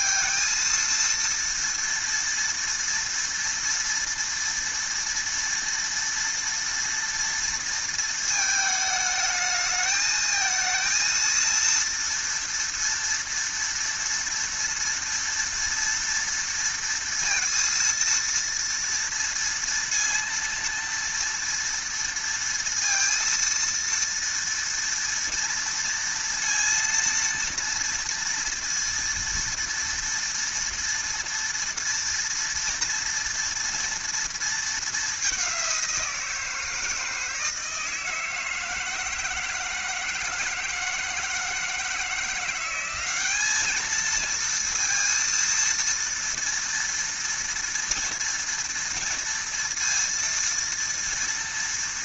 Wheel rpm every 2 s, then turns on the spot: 230, 230, 230, 230, 220, 230, 230, 230, 230, 230, 230, 230, 230, 230, 230, 230, 230, 220, 160, 160, 160, 180, 230, 230, 230, 230.
none